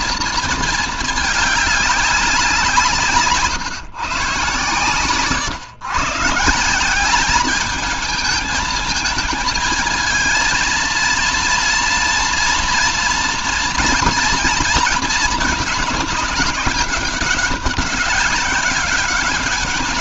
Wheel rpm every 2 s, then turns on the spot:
220, 170, 140, 190, 220, 230, 230, 230, 200, 200.
none